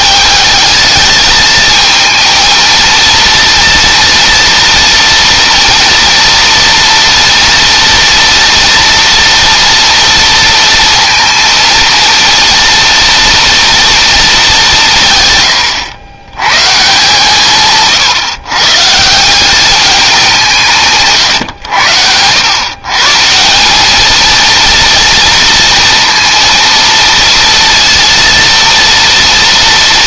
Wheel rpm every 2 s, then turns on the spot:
220, 230, 230, 230, 230, 230, 230, 150, 150, 150, 150, 140, 230, 230, 230.
none